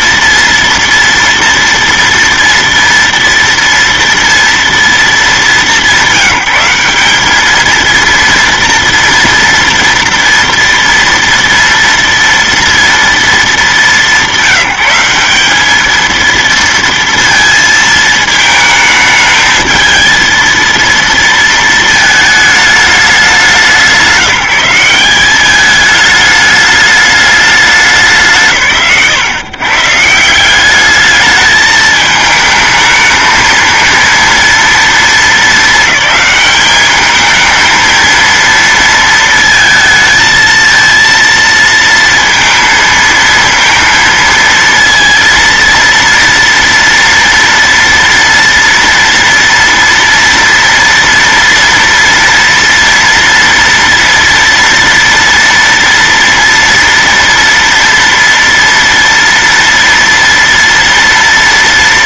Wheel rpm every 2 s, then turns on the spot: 230, 230, 220, 200, 230, 230, 230, 190, 230, 220, 230, 210, 190, 210, 120, 200, 220, 220, 210, 220, 230, 230, 230, 230, 230, 230, 230, 230, 230, 230, 230.
none